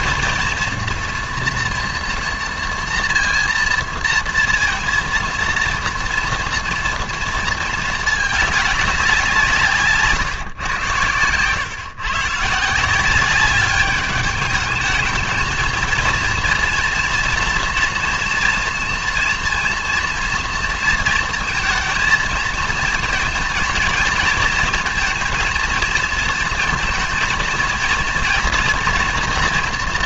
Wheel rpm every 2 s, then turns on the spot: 230, 230, 230, 230, 210, 130, 160, 220, 230, 230, 230, 230, 230, 230, 230.
none